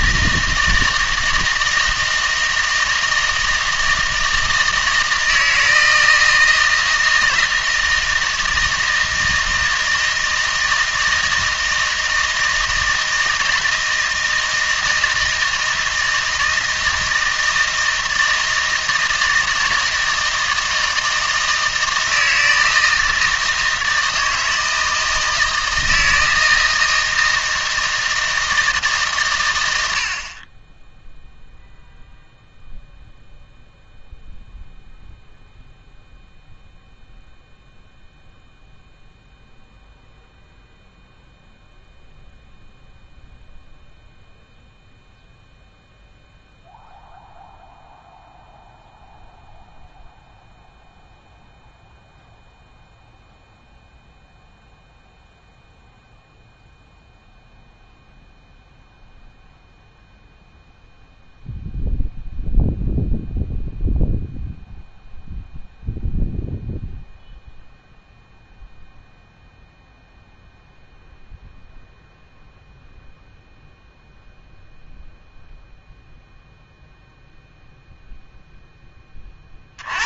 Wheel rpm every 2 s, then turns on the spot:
160, 160, 160, 160, 160, 160, 160, 160, 160, 160, 160, 160, 160, 160, 160, 20, 0, 0, 0, 0, 0, 0, 0, 0, 0, 0, 0, 0, 0, 0, 0, 0, 0, 0, 0, 0, 0, 0, 0, 10.
none